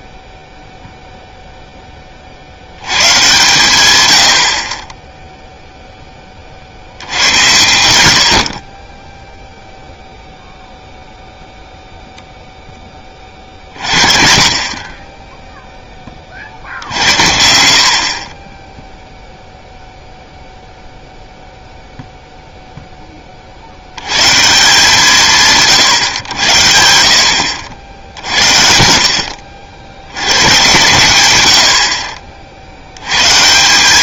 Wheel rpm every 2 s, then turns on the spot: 0, 70, 50, 70, 20, 0, 40, 10, 70, 0, 0, 20, 160, 70, 80, 100, 120.
none